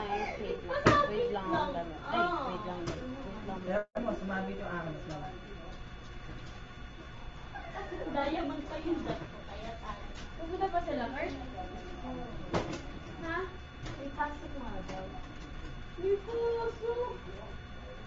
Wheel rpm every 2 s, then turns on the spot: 0, 0, 0, 0, 0, 0, 0, 0, 0.
none